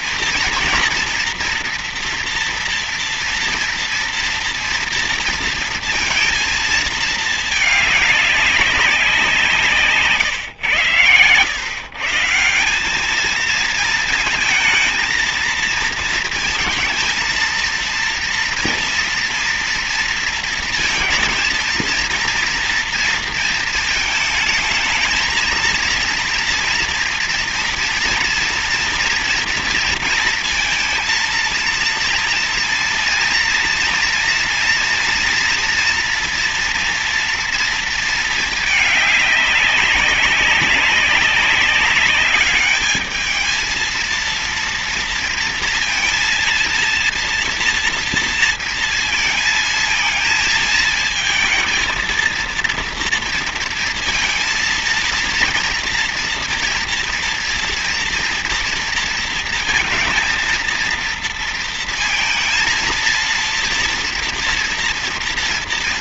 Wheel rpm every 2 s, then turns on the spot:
230, 230, 230, 230, 200, 130, 190, 220, 230, 230, 230, 230, 220, 230, 240, 230, 230, 230, 240, 220, 200, 210, 230, 230, 230, 220, 230, 230, 230, 230, 230, 230, 230.
none